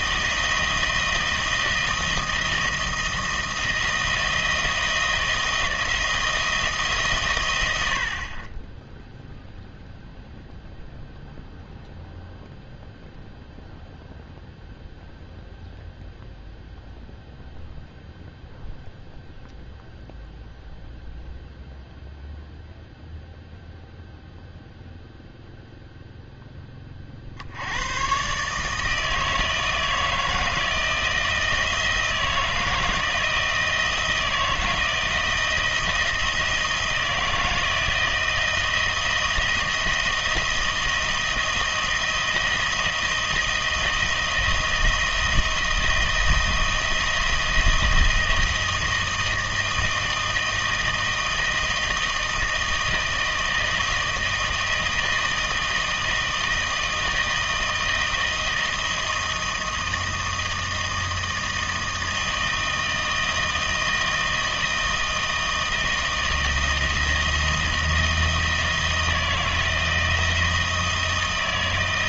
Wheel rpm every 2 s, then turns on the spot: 160, 160, 170, 160, 20, 0, 0, 0, 0, 0, 0, 0, 0, 10, 150, 160, 160, 160, 160, 160, 170, 160, 160, 160, 160, 160, 160, 160, 160, 160, 160, 160, 160, 160, 160, 160.
none